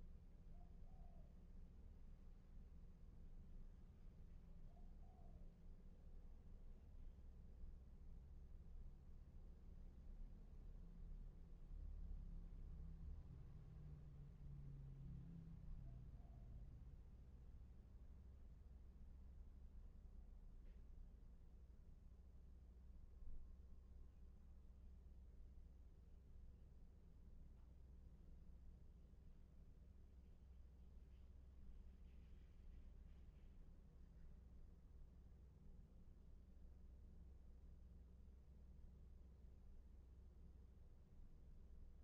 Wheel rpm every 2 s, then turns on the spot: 0, 0, 0, 0, 0, 0, 0, 0, 0, 0, 0, 0, 0, 0, 0, 0, 0, 0, 0, 0, 0.
none